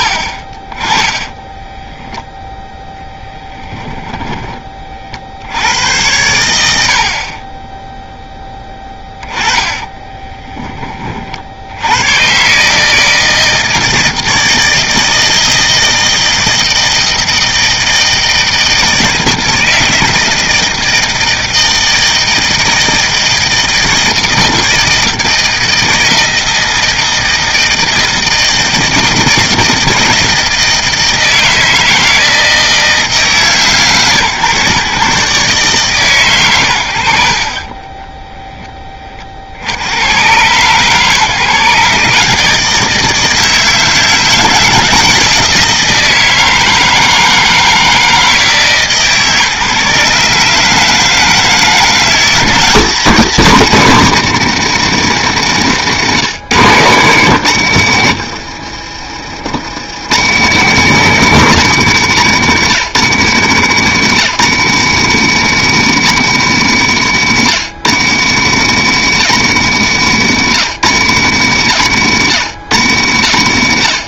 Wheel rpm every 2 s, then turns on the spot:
20, 0, 30, 70, 10, 20, 150, 160, 160, 160, 160, 160, 160, 160, 160, 160, 160, 130, 80, 10, 130, 160, 160, 160, 150, 150, 190, 150, 140, 50, 160, 140, 160, 130, 150, 130, 90.
56-60